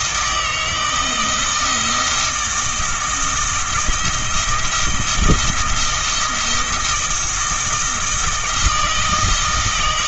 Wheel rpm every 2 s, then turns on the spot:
160, 160, 160, 170, 160.
none